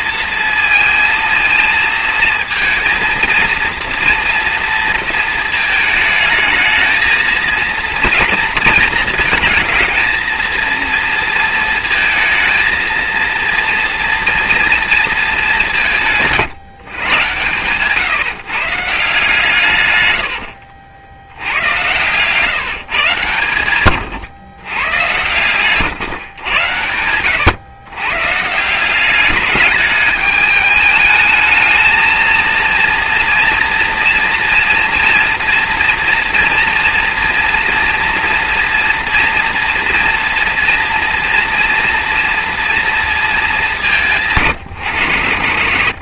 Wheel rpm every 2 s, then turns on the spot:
230, 230, 230, 220, 230, 230, 230, 230, 130, 150, 90, 140, 120, 100, 190, 220, 230, 230, 240, 230, 230, 220, 80.
26-28